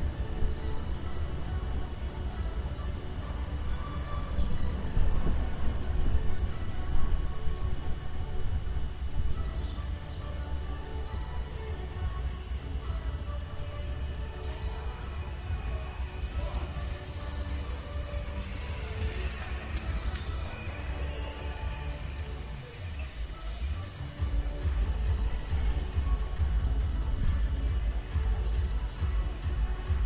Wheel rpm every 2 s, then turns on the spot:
0, 0, 0, 0, 0, 0, 0, 0, 0, 0, 0, 0, 0, 0, 0.
none